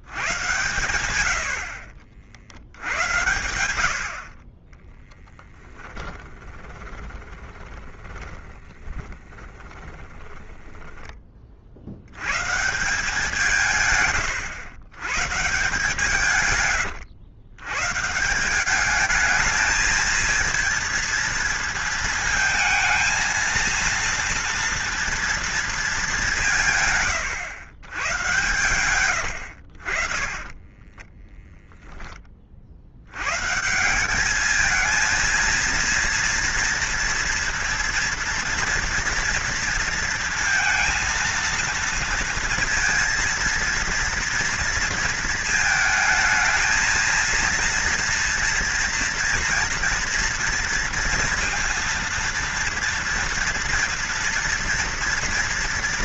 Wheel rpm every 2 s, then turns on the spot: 110, 80, 10, 20, 20, 20, 170, 120, 110, 200, 230, 230, 230, 130, 120, 20, 60, 220, 230, 230, 230, 230, 230, 220, 230, 230, 230, 230.
4-10 28-32